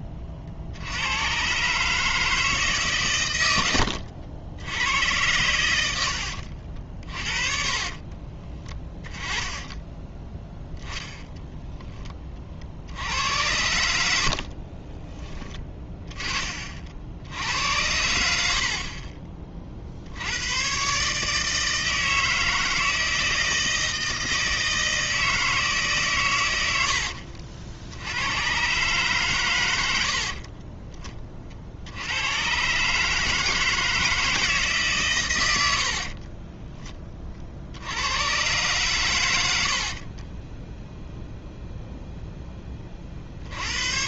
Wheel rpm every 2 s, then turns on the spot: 40, 150, 90, 60, 20, 0, 60, 50, 50, 50, 110, 160, 160, 100, 120, 30, 120, 150, 20, 130, 30, 20.
14-16 30-32 40-42